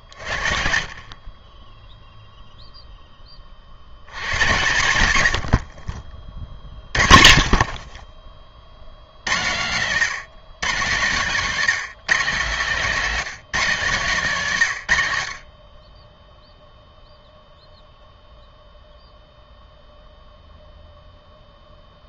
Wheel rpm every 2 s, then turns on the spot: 50, 0, 110, 30, 60, 140, 180, 140, 0, 0, 0.
none